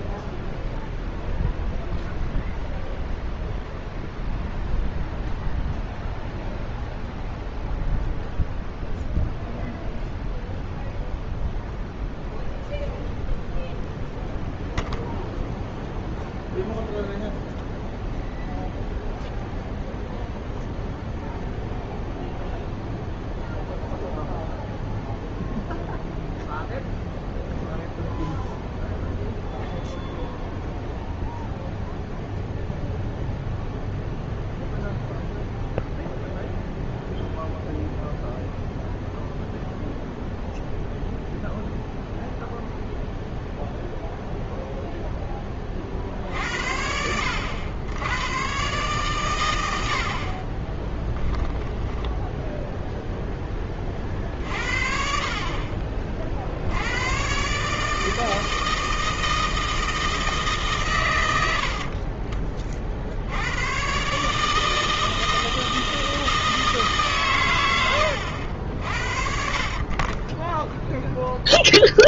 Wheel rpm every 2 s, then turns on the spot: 0, 0, 0, 0, 0, 0, 0, 0, 0, 0, 0, 0, 0, 0, 0, 0, 0, 0, 0, 0, 0, 0, 10, 80, 120, 10, 0, 50, 120, 160, 100, 70, 160, 140, 50, 0.
50-52 68-70